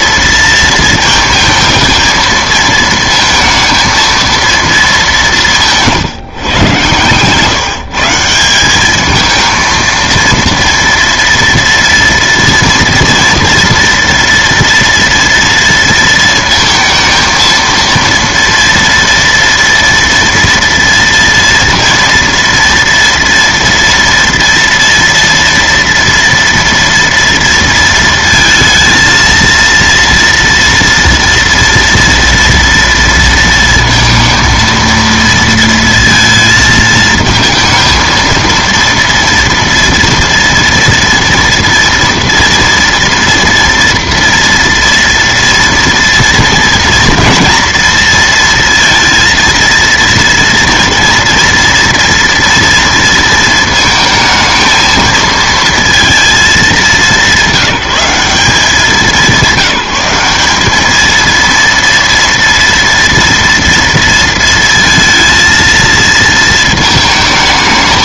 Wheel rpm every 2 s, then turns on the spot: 230, 230, 210, 130, 200, 230, 230, 230, 230, 230, 230, 230, 230, 230, 230, 230, 230, 230, 220, 230, 230, 230, 230, 230, 230, 230, 230, 220, 210, 190, 210, 230, 230, 220.
6-8